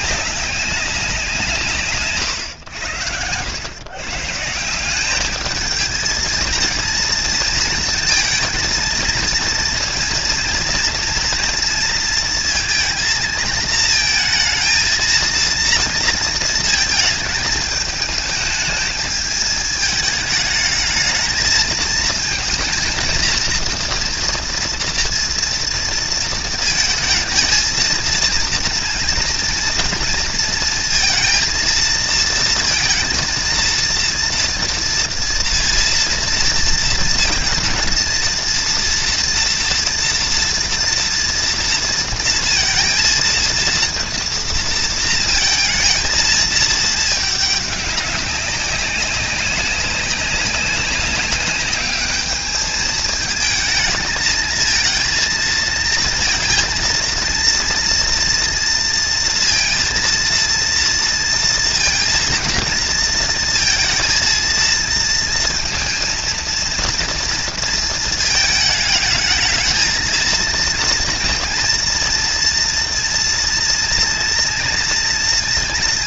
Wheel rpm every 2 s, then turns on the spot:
200, 90, 180, 230, 230, 230, 230, 230, 230, 220, 220, 230, 230, 220, 230, 230, 230, 230, 230, 230, 230, 230, 230, 220, 190, 190, 210, 220, 230, 230, 230, 230, 230, 230, 220, 230, 230, 230.
none